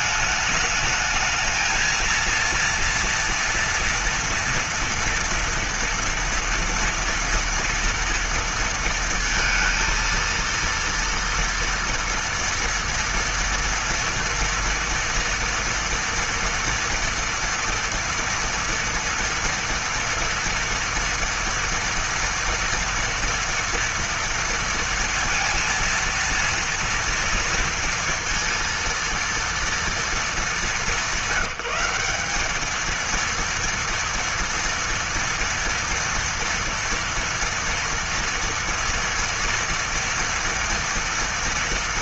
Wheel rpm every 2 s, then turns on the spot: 210, 230, 240, 230, 230, 230, 230, 230, 230, 240, 230, 230, 230, 230, 230, 220, 210, 230, 230, 230, 230.
none